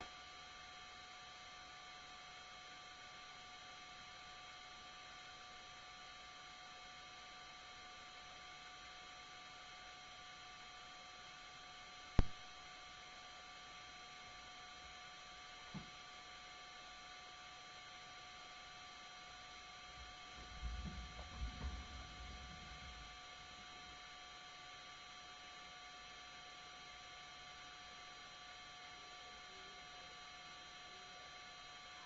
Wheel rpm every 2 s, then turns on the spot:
0, 0, 0, 0, 0, 0, 0, 0, 0, 0, 0, 0, 0, 0, 0, 0.
none